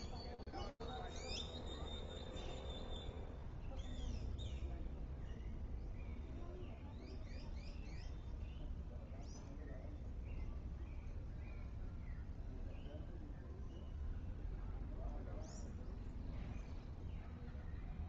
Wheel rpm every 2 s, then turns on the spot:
0, 0, 0, 0, 0, 0, 0, 0, 0.
none